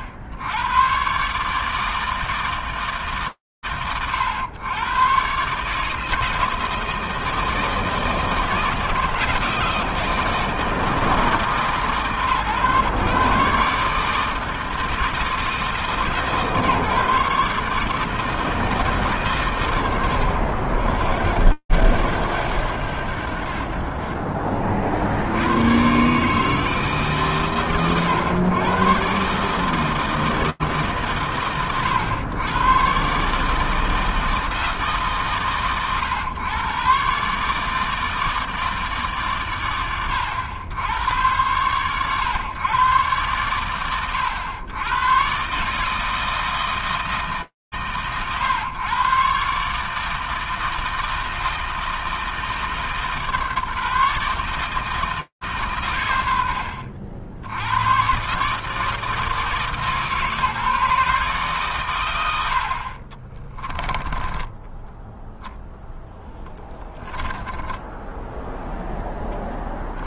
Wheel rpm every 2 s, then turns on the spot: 80, 150, 120, 160, 160, 160, 140, 160, 140, 160, 90, 100, 40, 150, 100, 160, 110, 160, 110, 160, 90, 120, 90, 160, 120, 160, 160, 150, 60, 150, 150, 80, 10, 0, 0.
64-66